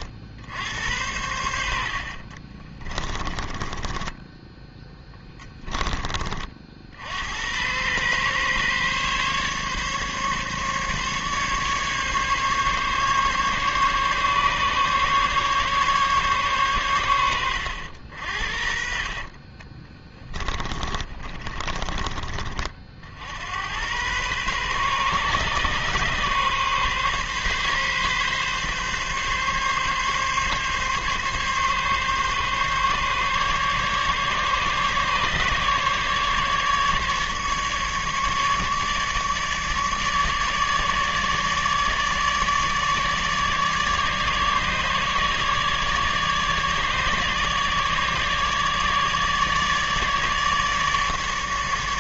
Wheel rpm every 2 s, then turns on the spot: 90, 20, 10, 60, 140, 140, 140, 140, 120, 50, 30, 50, 130, 130, 140, 140, 140, 150, 150, 150, 150, 150, 150, 150, 150, 150.
2-6 18-22